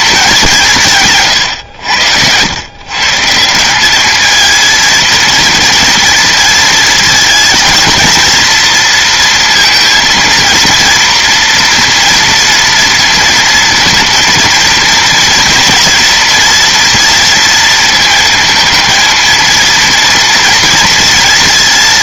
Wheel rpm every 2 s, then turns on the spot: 170, 120, 230, 230, 230, 230, 230, 230, 230, 220, 230.
none